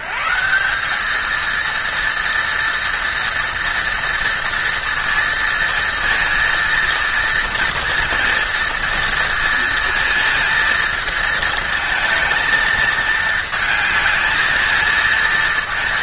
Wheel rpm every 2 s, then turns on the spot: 190, 230, 230, 230, 230, 230, 220, 220.
none